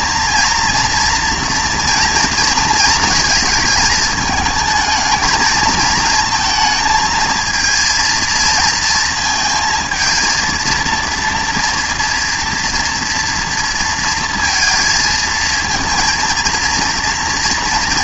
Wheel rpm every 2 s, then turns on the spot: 230, 230, 220, 230, 230, 220, 230, 230, 230.
none